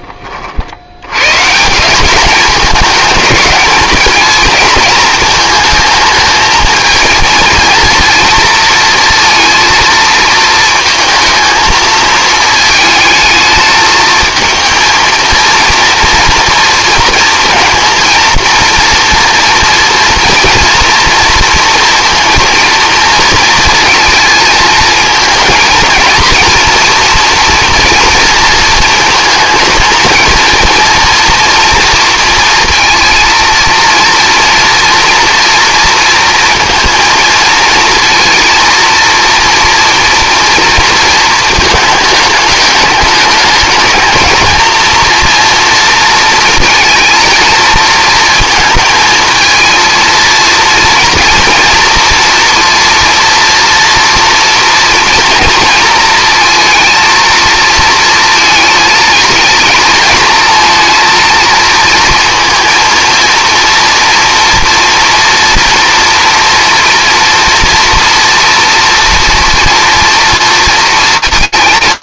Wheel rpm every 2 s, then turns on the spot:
70, 210, 220, 220, 230, 220, 220, 220, 230, 230, 230, 230, 230, 240, 230, 230, 230, 230, 230, 230, 230, 210, 220, 230, 230, 230, 230, 230, 230, 220, 230, 230, 230, 230, 230, 230.
none